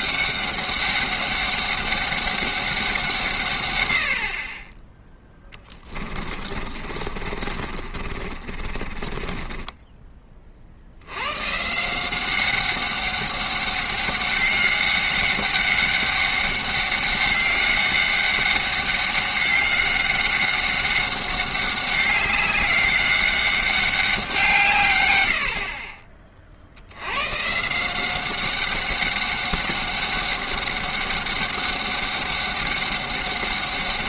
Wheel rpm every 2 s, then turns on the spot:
200, 190, 20, 30, 30, 60, 200, 200, 200, 200, 190, 190, 140, 80, 190, 200, 200.
6-10